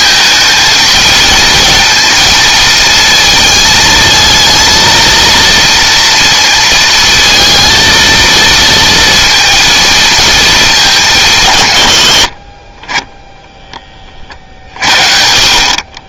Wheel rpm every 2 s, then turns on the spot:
220, 230, 230, 230, 230, 200, 20, 60.
none